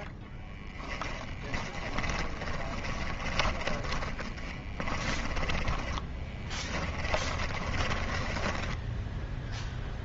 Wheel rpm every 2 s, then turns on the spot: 10, 20, 30, 10, 10.
0-10